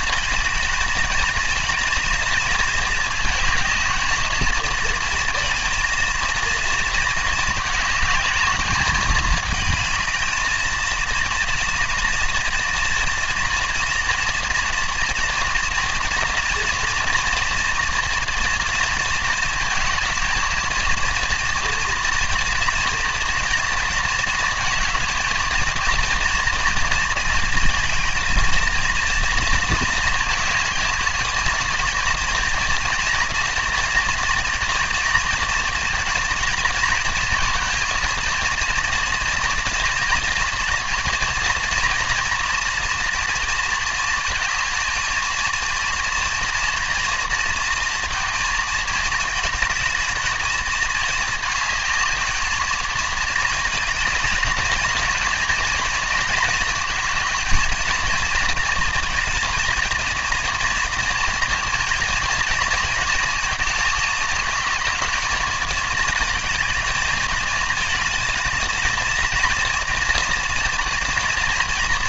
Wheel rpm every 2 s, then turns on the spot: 220, 230, 230, 230, 210, 230, 230, 230, 230, 230, 230, 230, 220, 220, 220, 220, 230, 240, 230, 230, 240, 230, 230, 230, 220, 220, 220, 230, 220, 230, 230, 230, 220, 220, 230, 230.
none